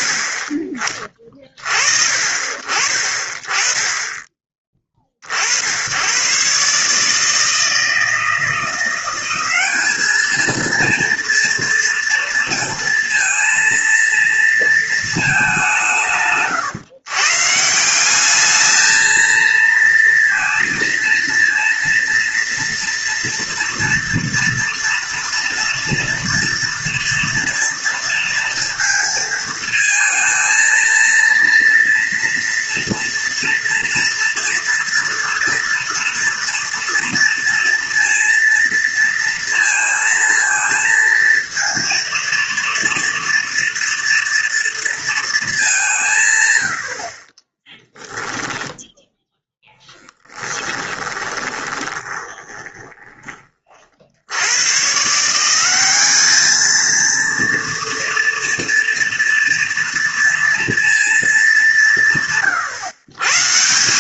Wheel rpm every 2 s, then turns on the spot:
20, 40, 20, 140, 170, 230, 230, 230, 140, 210, 230, 230, 230, 240, 230, 230, 230, 240, 240, 230, 230, 230, 230, 90, 0, 10, 20, 100, 220, 230, 230, 140.
50-54